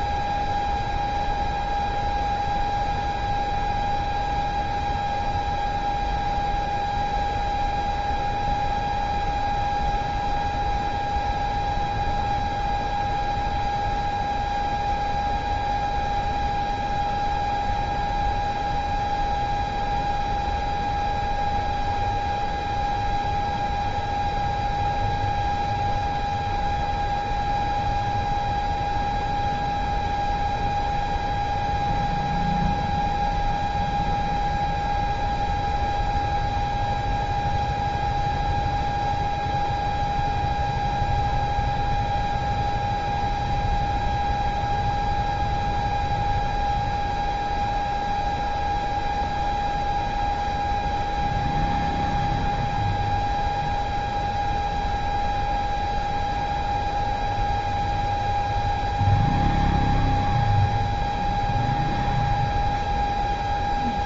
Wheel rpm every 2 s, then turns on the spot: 0, 0, 0, 0, 0, 0, 0, 0, 0, 0, 0, 0, 0, 0, 0, 0, 0, 0, 0, 0, 0, 0, 0, 0, 0, 0, 0, 0, 0, 0, 0, 0.
none